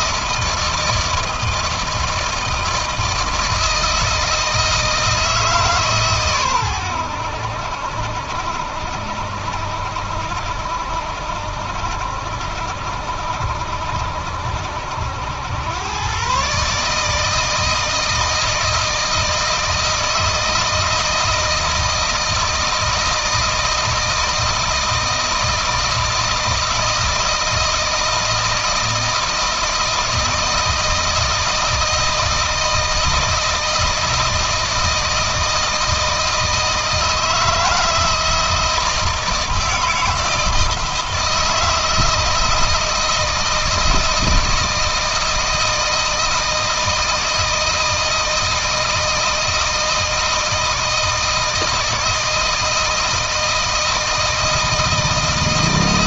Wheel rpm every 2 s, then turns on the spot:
160, 160, 160, 90, 70, 70, 70, 80, 150, 160, 160, 160, 160, 160, 160, 160, 160, 160, 160, 160, 160, 160, 160, 160, 160, 160, 160, 160.
none